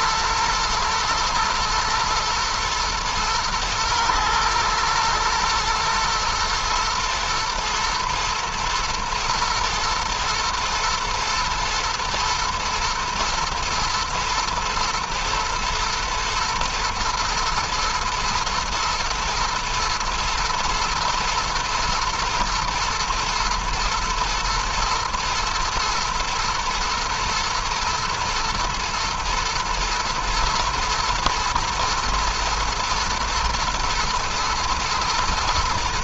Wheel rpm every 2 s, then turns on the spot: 110, 110, 120, 120, 110, 120, 110, 120, 110, 110, 120, 110, 110, 110, 110, 120, 120, 110.
none